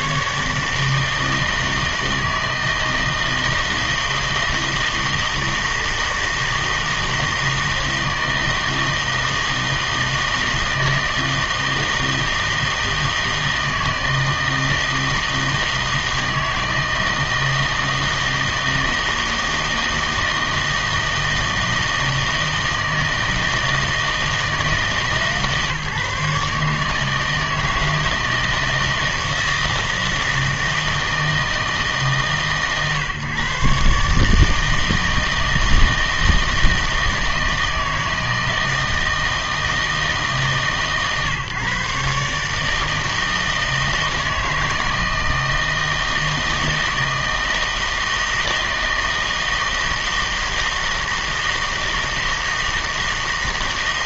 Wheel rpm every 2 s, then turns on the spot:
150, 160, 160, 160, 160, 160, 160, 160, 160, 160, 160, 160, 160, 150, 160, 160, 140, 160, 160, 160, 150, 150, 160, 160, 160, 160, 160.
none